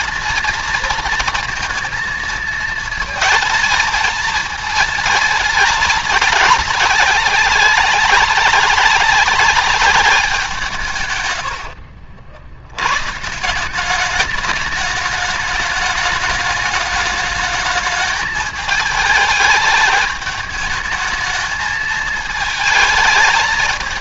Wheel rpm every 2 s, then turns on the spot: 230, 220, 210, 190, 200, 130, 140, 210, 210, 210, 210, 220.
10-12